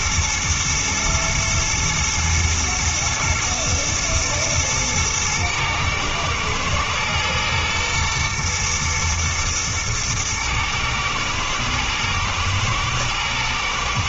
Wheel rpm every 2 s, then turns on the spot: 110, 110, 110, 110, 110, 110, 110.
none